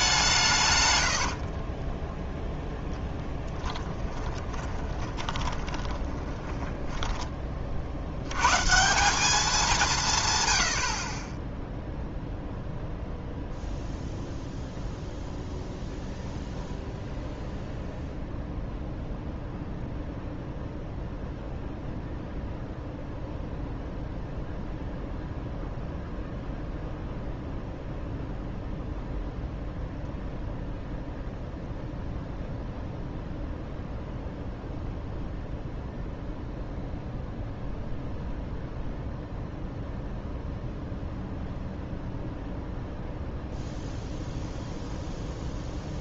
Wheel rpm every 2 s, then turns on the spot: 130, 0, 20, 10, 150, 80, 0, 0, 0, 0, 0, 0, 0, 0, 0, 0, 0, 0, 0, 0, 0, 0, 0.
4-8